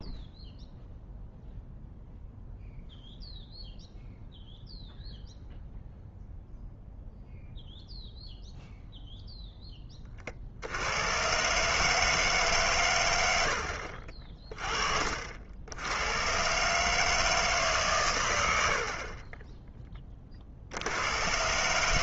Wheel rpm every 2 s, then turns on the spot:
0, 0, 0, 0, 0, 60, 140, 30, 130, 80, 60.
14-16